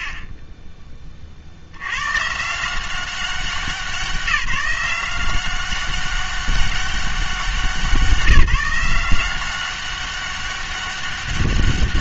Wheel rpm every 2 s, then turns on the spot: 30, 170, 180, 200, 170, 200.
0-2